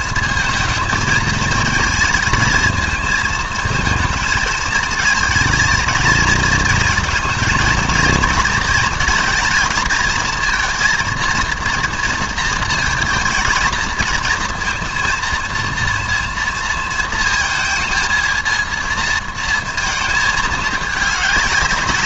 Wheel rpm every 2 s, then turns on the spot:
220, 220, 230, 230, 230, 230, 230, 230, 230, 230, 220.
none